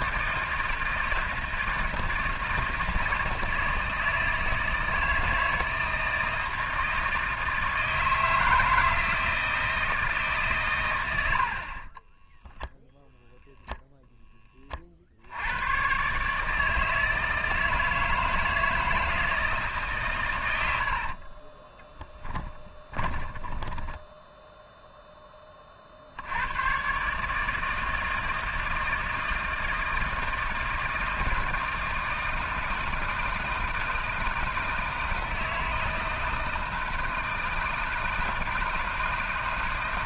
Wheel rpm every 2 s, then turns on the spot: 160, 160, 160, 160, 160, 100, 0, 50, 160, 160, 60, 10, 0, 130, 160, 160, 160, 160, 160, 160.
20-24